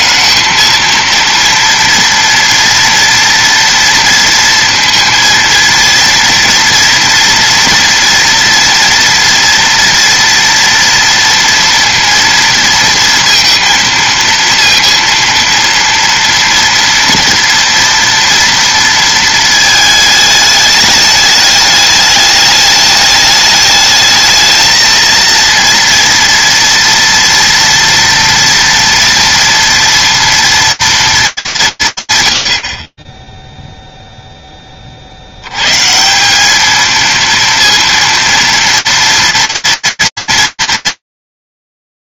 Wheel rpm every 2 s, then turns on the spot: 230, 230, 230, 230, 230, 230, 230, 230, 230, 230, 210, 210, 230, 230, 230, 240, 70, 30, 220, 230, 230.
none